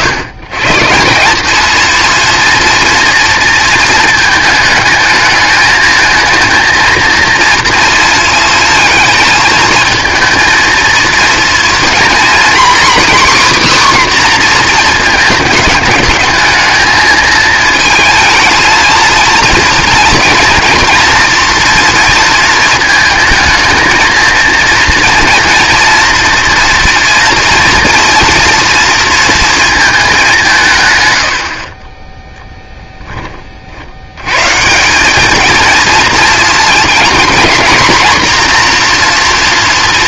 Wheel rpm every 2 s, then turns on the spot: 140, 230, 220, 230, 230, 220, 270, 240, 220, 230, 230, 220, 230, 240, 230, 150, 10, 160, 220, 240.
none